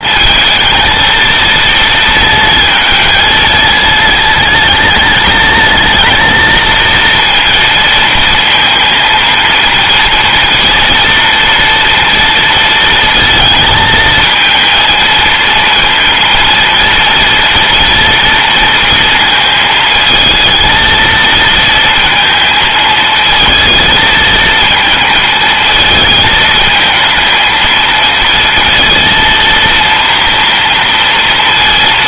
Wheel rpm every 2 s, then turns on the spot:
220, 230, 230, 230, 230, 230, 220, 230, 230, 230, 230, 220, 230, 220, 230, 230.
none